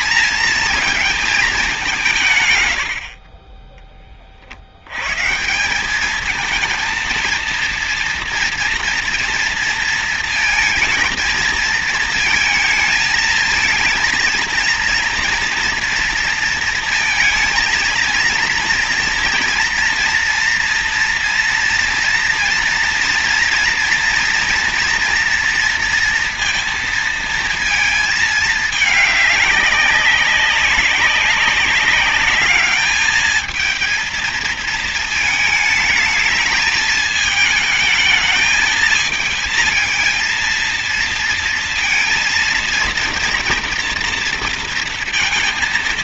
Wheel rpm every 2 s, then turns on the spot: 220, 70, 90, 230, 230, 230, 220, 230, 230, 230, 230, 230, 230, 230, 210, 200, 210, 220, 220, 220, 230, 230, 230.
none